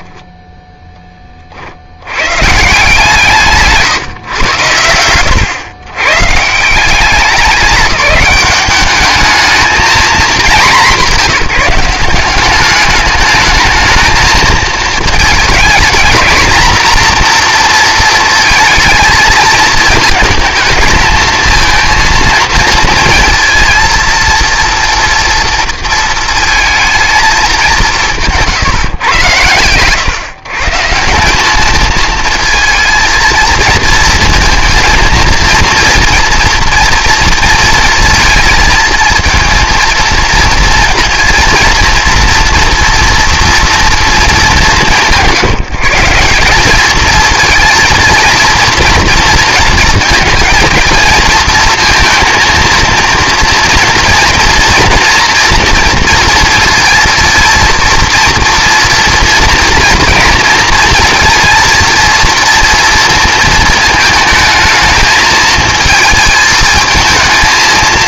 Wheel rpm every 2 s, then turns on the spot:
10, 150, 100, 180, 210, 180, 200, 220, 240, 220, 220, 230, 230, 220, 140, 150, 220, 230, 230, 220, 230, 230, 170, 210, 230, 230, 230, 230, 230, 230, 230, 230, 220, 220.
none